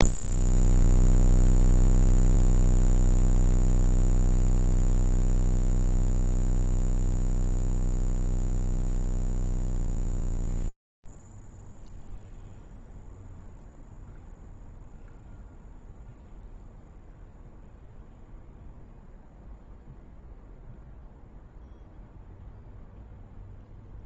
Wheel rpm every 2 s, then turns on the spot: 0, 0, 0, 0, 0, 0, 0, 0, 0, 0, 0, 0.
none